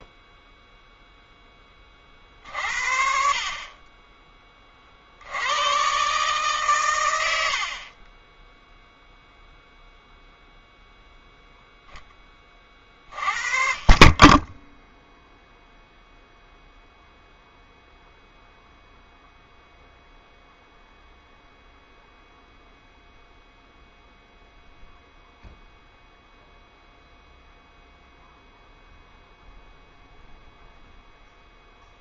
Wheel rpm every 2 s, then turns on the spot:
0, 50, 40, 140, 0, 0, 40, 0, 0, 0, 0, 0, 0, 0, 0, 0.
none